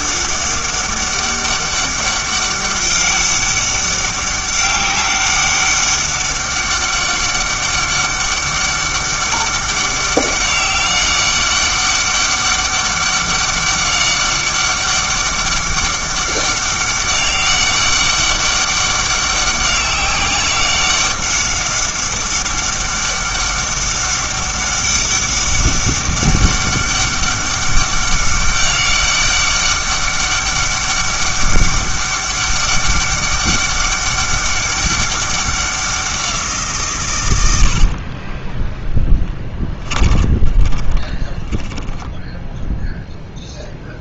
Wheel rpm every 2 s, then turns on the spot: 200, 200, 200, 200, 200, 200, 200, 200, 200, 200, 190, 200, 200, 200, 200, 200, 200, 200, 160, 20, 20, 0.
38-42